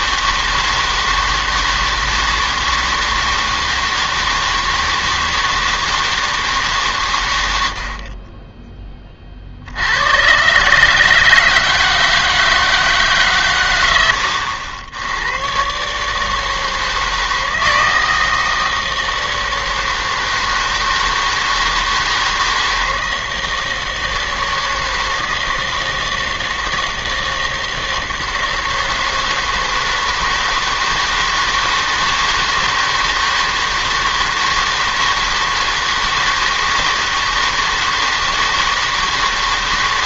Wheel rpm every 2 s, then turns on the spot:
160, 160, 160, 150, 10, 140, 160, 80, 160, 160, 160, 160, 160, 160, 160, 160, 160, 160, 160, 160.
none